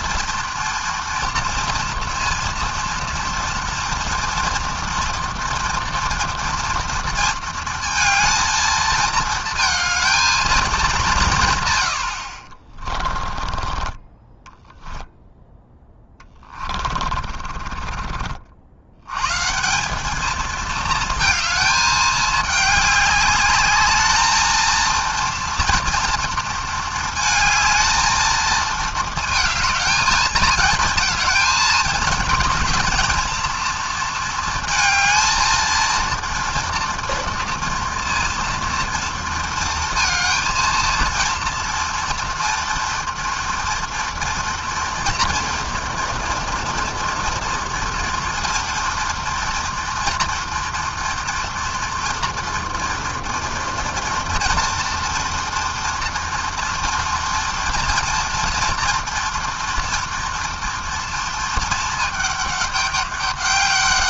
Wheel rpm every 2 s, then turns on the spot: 230, 230, 230, 230, 220, 130, 20, 0, 40, 130, 220, 200, 230, 220, 220, 220, 230, 230, 230, 230, 230, 230, 240, 230, 230, 240, 230, 230, 240, 230, 230, 200.
12-14 16-18